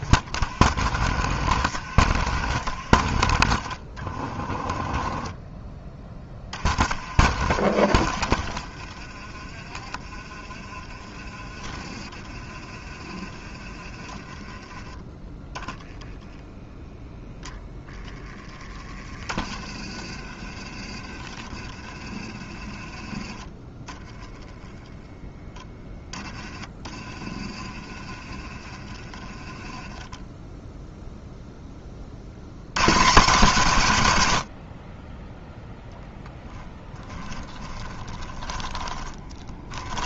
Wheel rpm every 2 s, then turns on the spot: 50, 50, 20, 40, 30, 30, 30, 10, 0, 20, 30, 20, 0, 20, 20, 0, 120, 40, 20, 20.
4-6 36-40